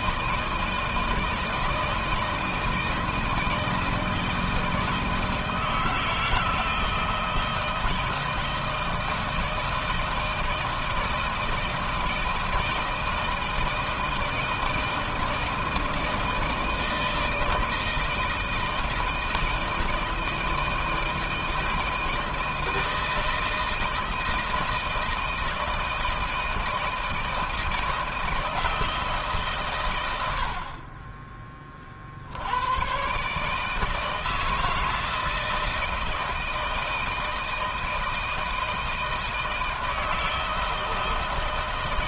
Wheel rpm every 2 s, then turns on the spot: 160, 160, 160, 160, 160, 160, 160, 160, 160, 160, 160, 160, 160, 160, 160, 30, 120, 160, 160, 160, 160.
none